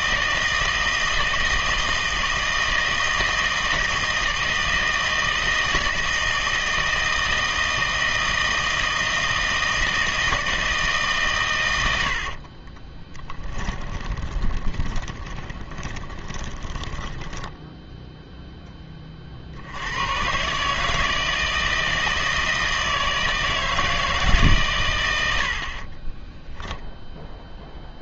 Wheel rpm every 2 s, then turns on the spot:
160, 160, 160, 160, 160, 160, 40, 20, 10, 10, 140, 160, 140, 10.
12-18 26-28